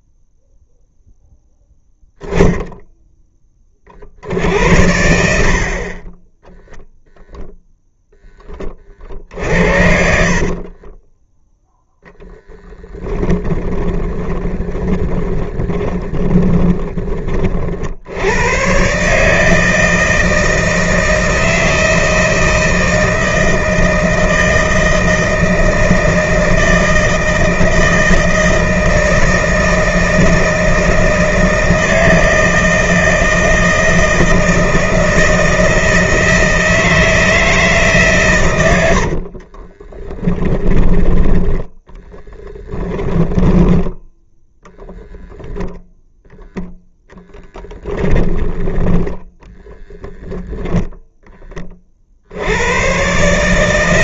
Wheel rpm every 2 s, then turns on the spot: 0, 10, 70, 0, 40, 20, 20, 30, 20, 140, 160, 160, 160, 160, 160, 160, 160, 160, 160, 70, 10, 20, 0, 0, 20, 10, 120.
10-16 38-40 42-44 48-50